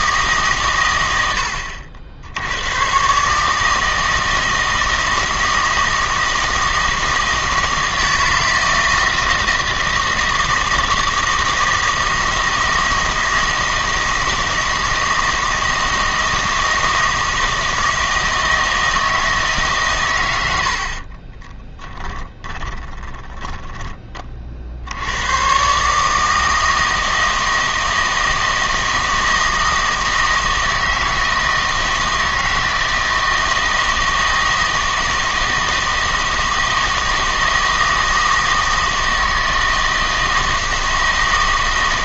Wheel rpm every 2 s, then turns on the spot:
120, 110, 160, 160, 160, 160, 160, 160, 160, 160, 70, 10, 60, 160, 160, 160, 160, 160, 160, 160, 160.
22-24